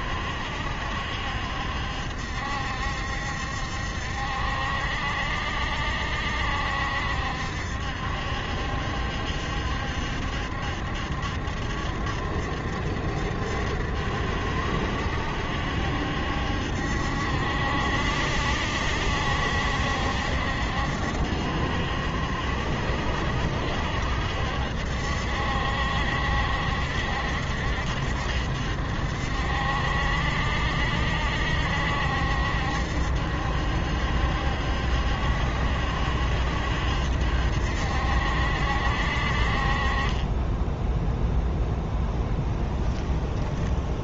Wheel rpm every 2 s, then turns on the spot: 70, 70, 70, 70, 70, 70, 70, 70, 70, 70, 70, 60, 70, 70, 70, 70, 70, 70, 70, 60, 10, 10.
42-44